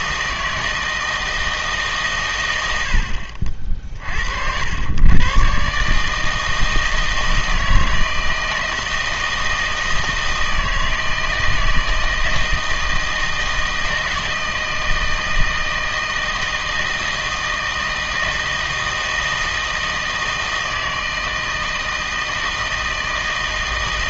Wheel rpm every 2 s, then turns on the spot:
160, 100, 100, 160, 160, 160, 160, 160, 160, 160, 160, 160.
none